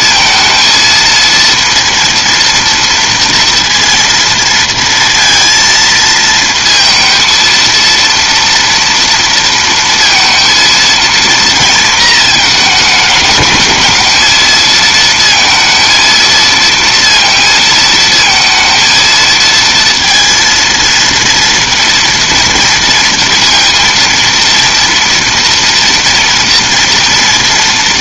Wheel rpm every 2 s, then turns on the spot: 230, 230, 230, 230, 230, 230, 210, 230, 230, 230, 230, 230, 230, 230.
none